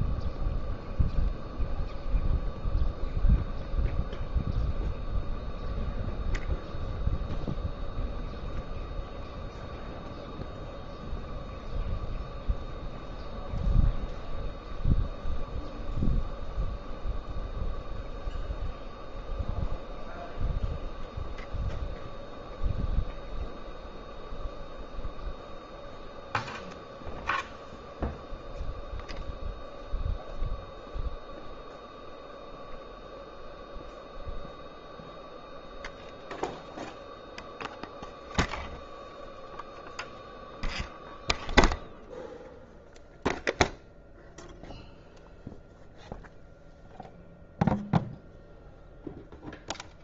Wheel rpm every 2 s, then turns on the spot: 0, 0, 0, 0, 0, 0, 0, 0, 0, 0, 0, 0, 0, 0, 0, 0, 0, 0, 0, 0, 0, 0, 0, 0, 0.
none